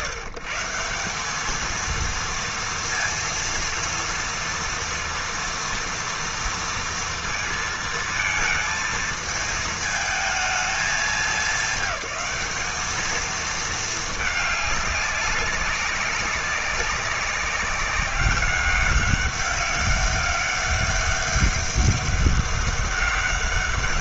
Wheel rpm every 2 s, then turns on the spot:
150, 230, 230, 230, 220, 210, 200, 200, 190, 200, 200, 200.
none